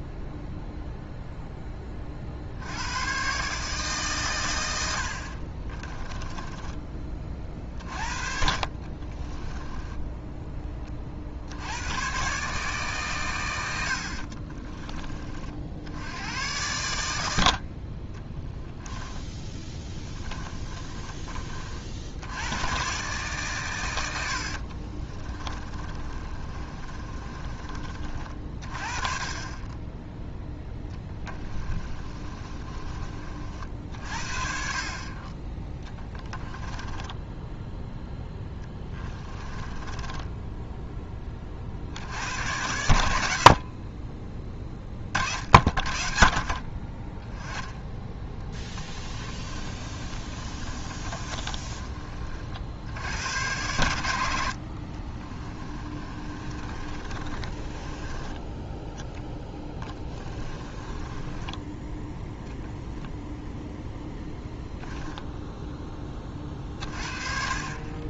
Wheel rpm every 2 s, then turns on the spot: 0, 80, 90, 20, 40, 20, 140, 30, 100, 10, 30, 120, 40, 30, 30, 10, 30, 40, 10, 10, 10, 80, 20, 30, 10, 30, 70, 60, 30, 10, 20, 0, 10, 30.
8-10 14-16 18-22 24-28 30-32 36-40 48-52 54-58 60-62 64-66